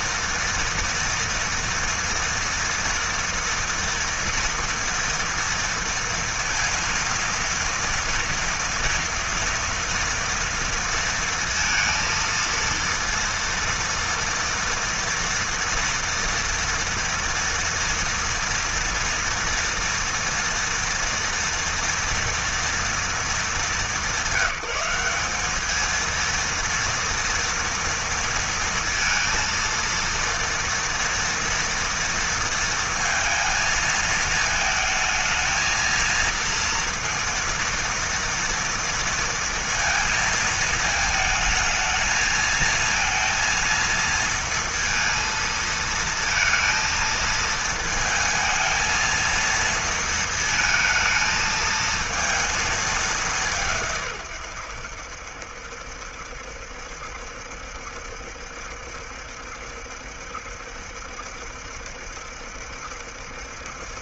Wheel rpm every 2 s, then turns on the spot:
230, 230, 230, 230, 230, 230, 230, 230, 230, 230, 230, 230, 180, 230, 230, 230, 230, 220, 230, 230, 220, 220, 230, 230, 220, 220, 220, 110, 70, 70, 70, 70.
none